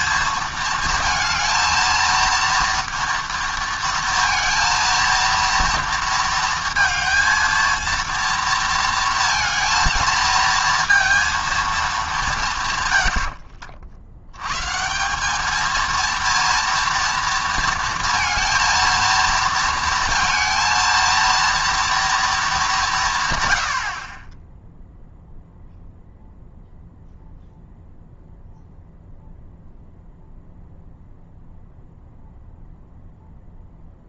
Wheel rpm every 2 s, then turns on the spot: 220, 230, 230, 230, 230, 230, 130, 150, 230, 230, 230, 200, 10, 0, 0, 0, 0.
none